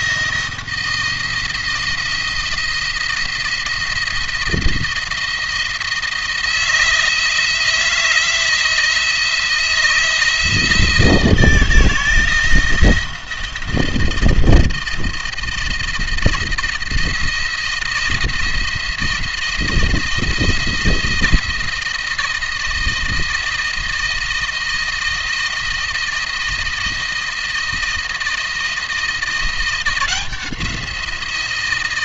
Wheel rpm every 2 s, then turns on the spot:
170, 170, 170, 160, 160, 160, 170, 160, 170, 170, 170, 160, 160, 160, 170, 170.
none